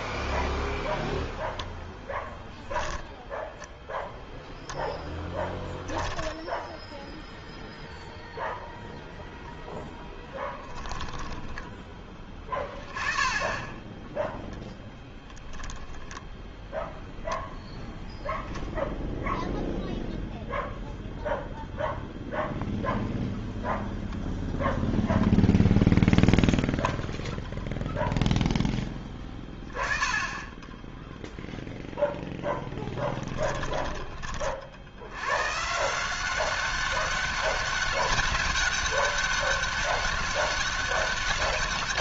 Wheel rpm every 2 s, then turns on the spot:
0, 0, 0, 0, 10, 10, 10, 0, 0, 0, 0, 0, 0, 0, 10, 10, 30, 190, 200, 200, 200.
12-14